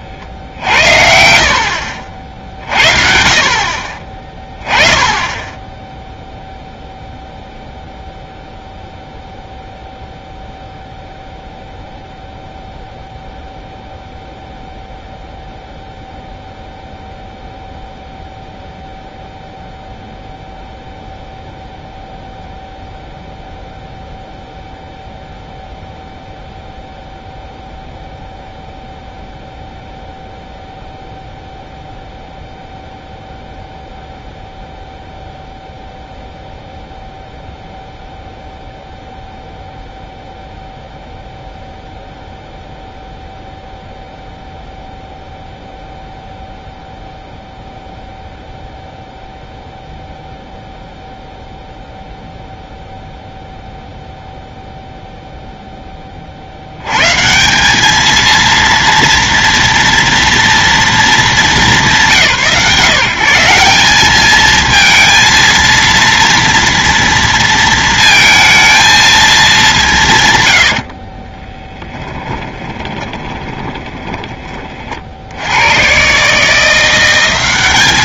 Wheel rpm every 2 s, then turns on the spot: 60, 60, 20, 0, 0, 0, 0, 0, 0, 0, 0, 0, 0, 0, 0, 0, 0, 0, 0, 0, 0, 0, 0, 0, 0, 0, 0, 0, 60, 230, 230, 160, 220, 230, 230, 120, 10, 30, 150.
72-74